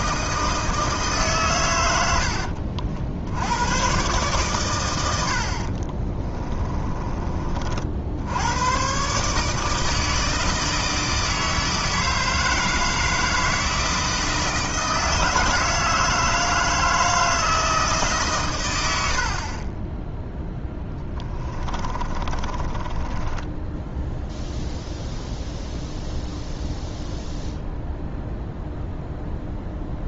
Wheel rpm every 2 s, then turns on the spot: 160, 60, 120, 30, 120, 160, 160, 160, 160, 100, 10, 30, 0, 0, 0.
6-8 20-24